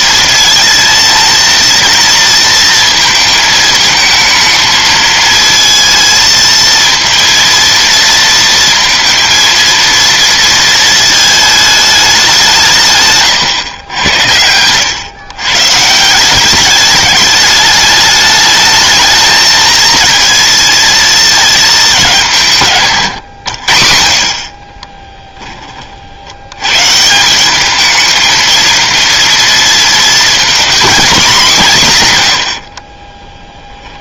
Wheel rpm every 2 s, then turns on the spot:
230, 230, 220, 230, 230, 230, 150, 100, 200, 220, 230, 150, 30, 140, 230, 230, 60.
14-16 24-26 32-34